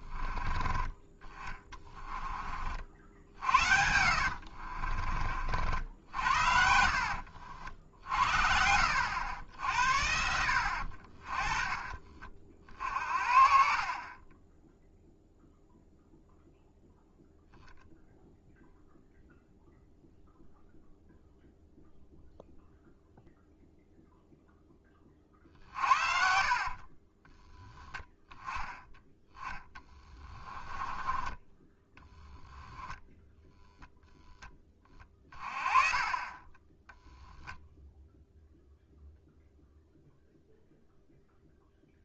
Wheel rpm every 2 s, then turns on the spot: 30, 50, 50, 60, 70, 60, 40, 0, 0, 0, 0, 0, 20, 40, 10, 20, 0, 20, 10, 0, 0.
4-8 26-28 30-32